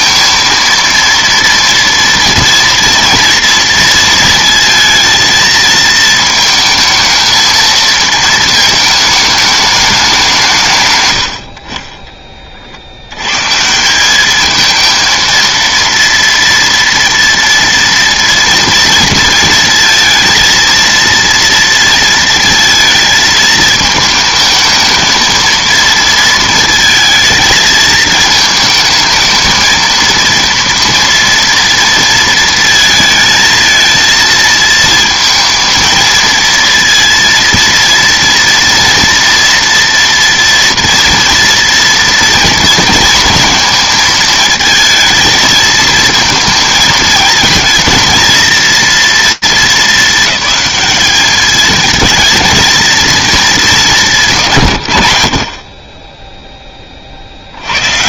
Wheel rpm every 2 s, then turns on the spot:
230, 230, 220, 220, 220, 170, 40, 220, 230, 240, 230, 230, 220, 220, 220, 230, 230, 220, 230, 230, 230, 230, 220, 220, 230, 210, 220, 150, 20.
none